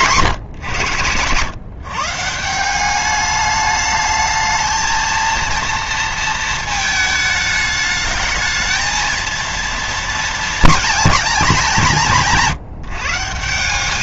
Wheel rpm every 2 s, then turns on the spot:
140, 190, 220, 220, 220, 220, 160.
none